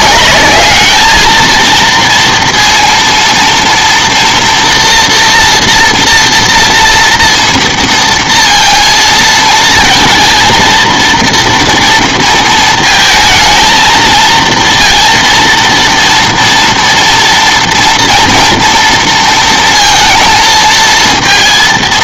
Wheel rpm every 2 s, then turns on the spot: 210, 230, 230, 240, 230, 230, 230, 230, 230, 230, 230.
none